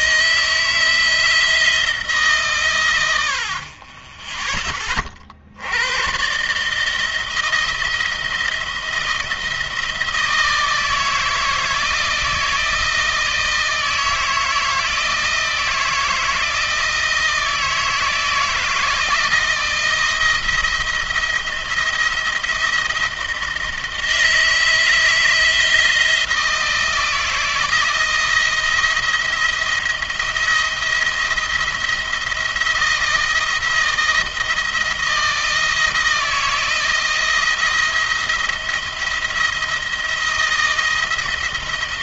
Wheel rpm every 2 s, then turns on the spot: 160, 130, 20, 150, 160, 160, 160, 160, 160, 160, 170, 170, 160, 160, 170, 160, 170, 170, 160, 170, 160.
none